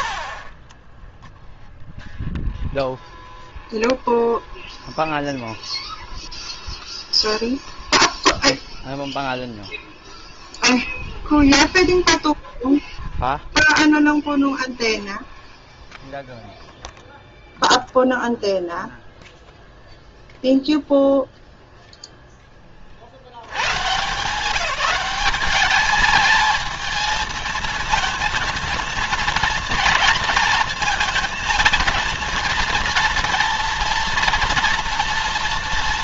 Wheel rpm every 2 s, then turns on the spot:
10, 0, 0, 0, 0, 0, 0, 0, 0, 0, 0, 50, 180, 220, 230, 220, 230, 230.
none